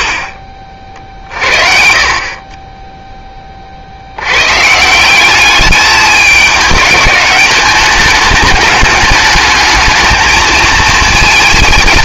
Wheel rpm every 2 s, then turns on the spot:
30, 10, 170, 210, 210, 220.
none